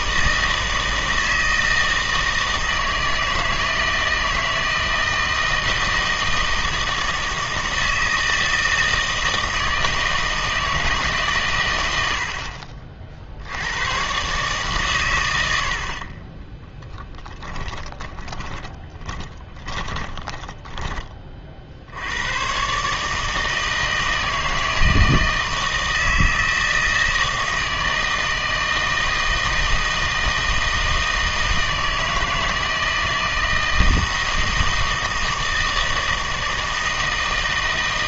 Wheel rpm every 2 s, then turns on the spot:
160, 160, 160, 160, 160, 160, 40, 140, 10, 20, 20, 140, 160, 160, 160, 160, 160, 160, 160.
16-20